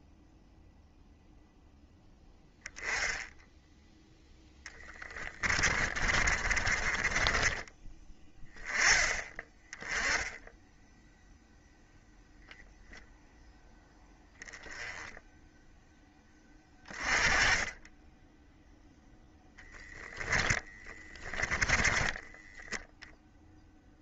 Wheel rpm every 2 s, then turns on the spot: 0, 10, 20, 30, 20, 0, 0, 10, 20, 0, 10, 0.
4-8 20-22